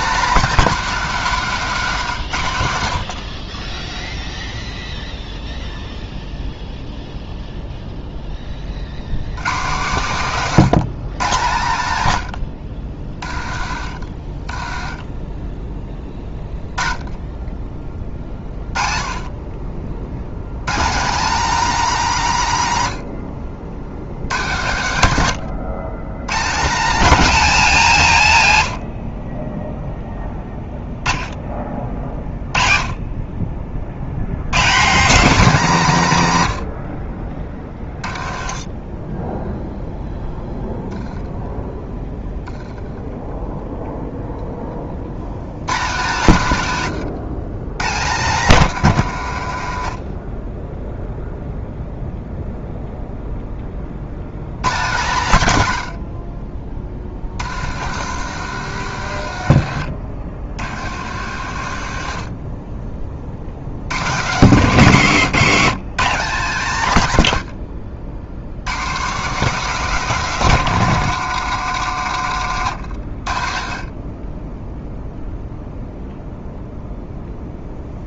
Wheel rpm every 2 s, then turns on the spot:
220, 70, 0, 0, 80, 150, 60, 20, 20, 30, 150, 100, 130, 210, 70, 10, 20, 180, 50, 20, 0, 10, 50, 140, 130, 0, 0, 130, 40, 100, 80, 30, 190, 130, 160, 200, 100, 0, 0.
14-16 38-40 42-44 56-62